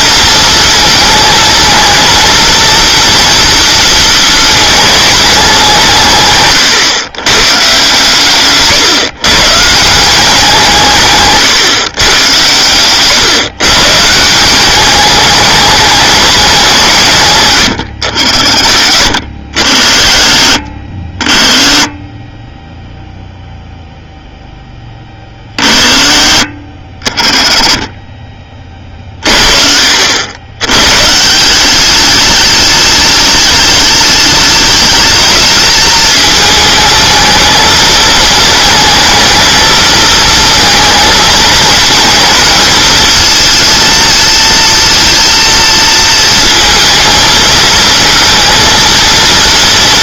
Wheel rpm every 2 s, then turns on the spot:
220, 230, 220, 130, 140, 170, 110, 190, 170, 70, 50, 10, 10, 50, 30, 110, 210, 210, 220, 220, 220, 230, 230, 220, 230.
12-14